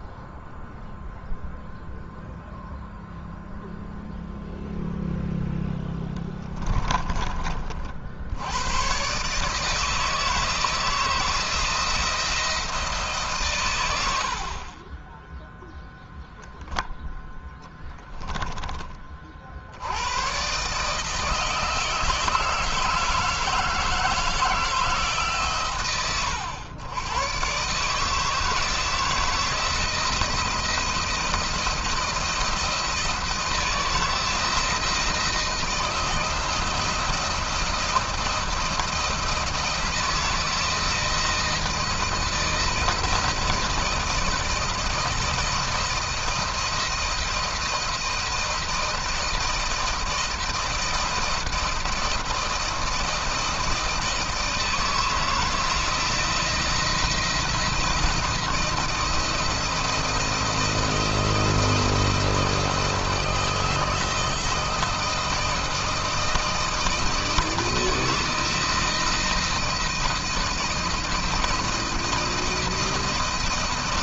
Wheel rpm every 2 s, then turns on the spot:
0, 0, 0, 10, 80, 160, 170, 80, 0, 20, 120, 160, 160, 110, 160, 160, 170, 170, 170, 170, 170, 170, 170, 160, 170, 160, 170, 160, 170, 170, 160, 160, 160, 160, 160, 170, 170.
6-8 18-20